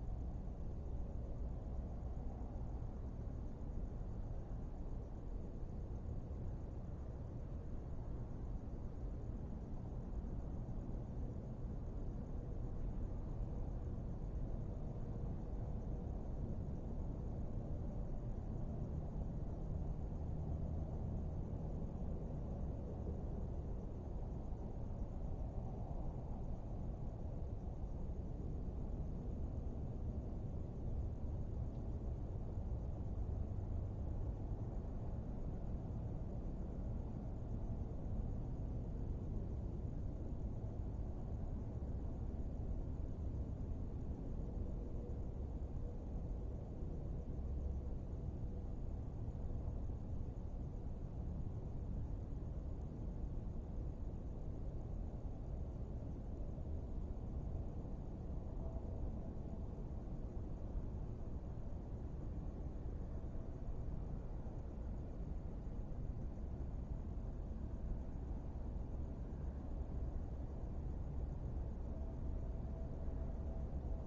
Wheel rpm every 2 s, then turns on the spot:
0, 0, 0, 0, 0, 0, 0, 0, 0, 0, 0, 0, 0, 0, 0, 0, 0, 0, 0, 0, 0, 0, 0, 0, 0, 0, 0, 0, 0, 0, 0, 0, 0, 0, 0, 0, 0.
none